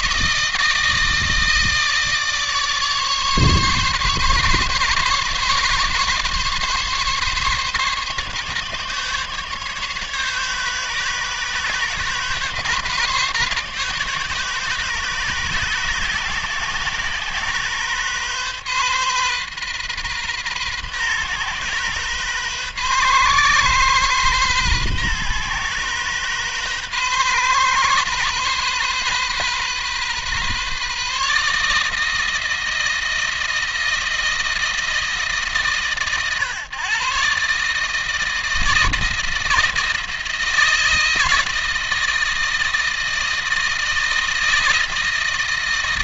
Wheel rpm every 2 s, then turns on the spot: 160, 150, 140, 140, 140, 140, 140, 140, 130, 130, 130, 130, 130, 130, 130, 140, 160, 160, 130, 160, 160, 160, 160.
none